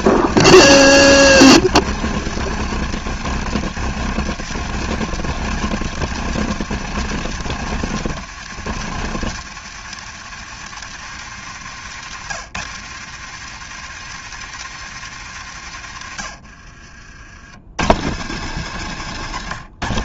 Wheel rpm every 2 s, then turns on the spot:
160, 160, 160, 150, 140, 120, 120, 110, 90, 140.
none